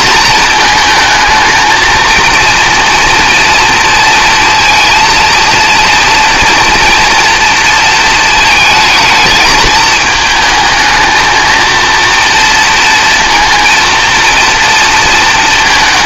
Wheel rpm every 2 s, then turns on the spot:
230, 230, 230, 230, 220, 220, 240, 230.
none